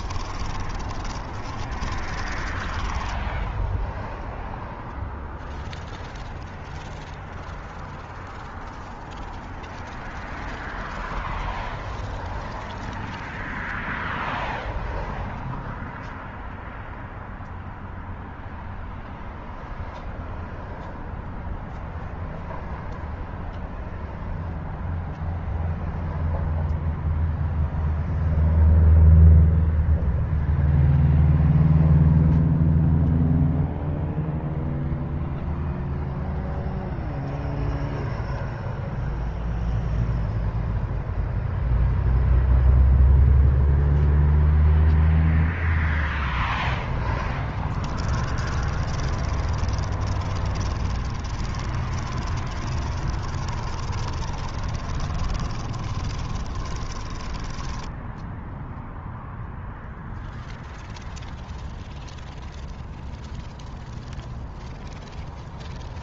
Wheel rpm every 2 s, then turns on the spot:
40, 10, 0, 0, 0, 0, 0, 0, 0, 0, 0, 0, 0, 0, 0, 0, 0, 0, 0, 0, 0, 0, 0, 10, 40, 30, 30, 30, 20, 0, 0, 0, 0.
0-4 46-58